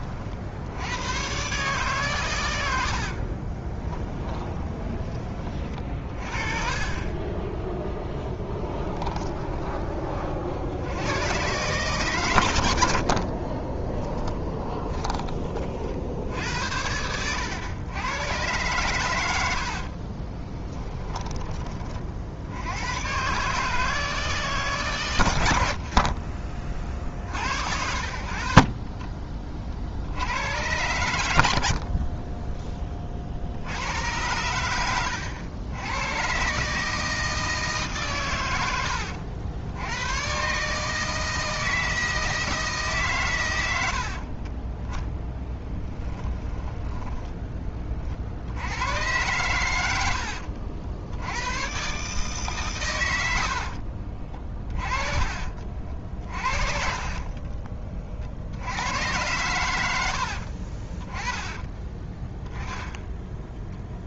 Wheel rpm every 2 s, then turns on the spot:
100, 70, 20, 30, 20, 90, 60, 20, 80, 110, 10, 120, 120, 20, 40, 110, 30, 100, 150, 90, 150, 150, 10, 10, 100, 70, 120, 30, 40, 90, 30, 10.
2-6 8-10 46-48 54-58 62-64